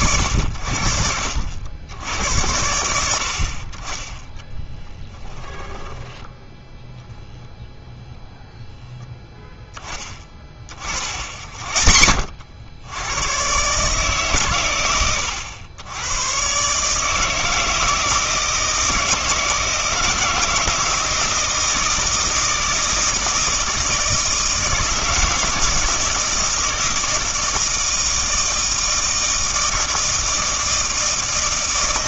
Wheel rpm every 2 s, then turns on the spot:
80, 90, 10, 0, 0, 50, 90, 120, 140, 160, 160, 160, 160, 160, 160, 160.
4-6